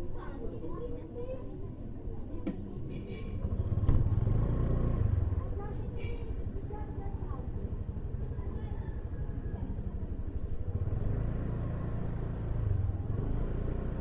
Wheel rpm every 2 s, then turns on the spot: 0, 0, 0, 0, 0, 0, 0.
none